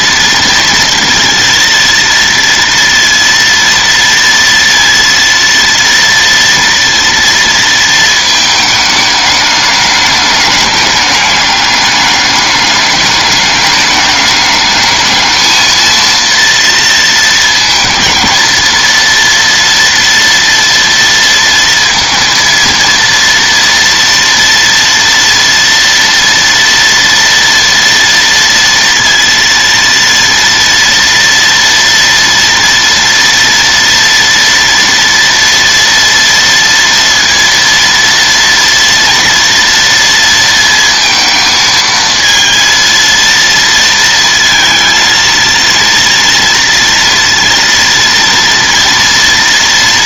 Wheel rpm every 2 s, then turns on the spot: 230, 230, 230, 230, 210, 210, 210, 220, 220, 230, 230, 230, 230, 230, 230, 230, 240, 230, 230, 240, 220, 230, 230, 230, 230.
none